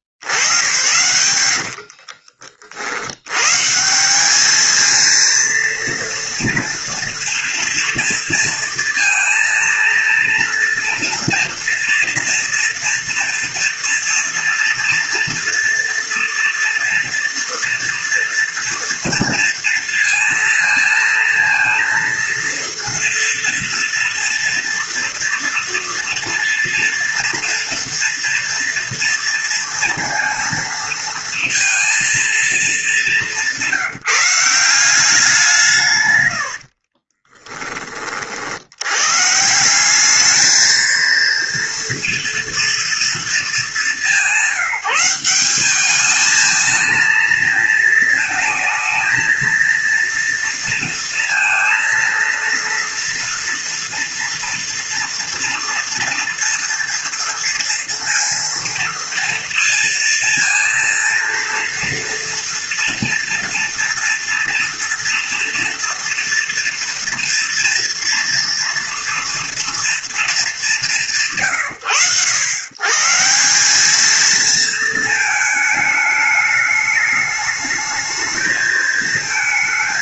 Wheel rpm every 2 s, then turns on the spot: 110, 70, 220, 230, 230, 230, 230, 230, 230, 230, 230, 230, 230, 230, 230, 230, 210, 180, 60, 100, 220, 230, 190, 220, 230, 230, 230, 230, 230, 230, 230, 240, 230, 230, 240, 150, 130, 220, 210, 220.
36-38